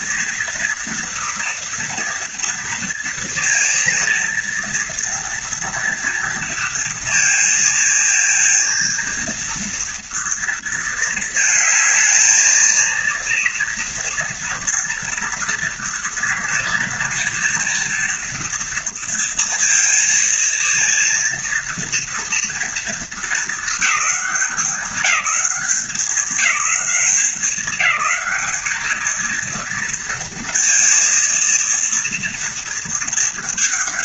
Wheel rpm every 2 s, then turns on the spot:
230, 230, 240, 230, 230, 230, 230, 230, 230, 230, 230, 230, 190, 190, 220, 230, 230.
none